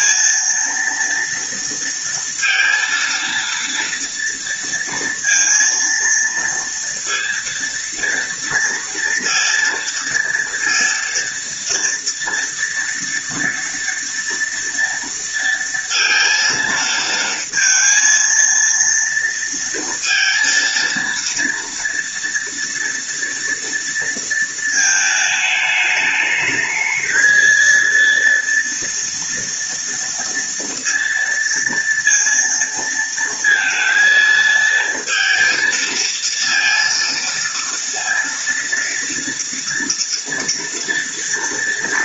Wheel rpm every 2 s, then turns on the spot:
230, 230, 230, 230, 230, 230, 230, 230, 230, 230, 230, 230, 220, 220, 240, 230, 230, 230, 230, 230, 230.
none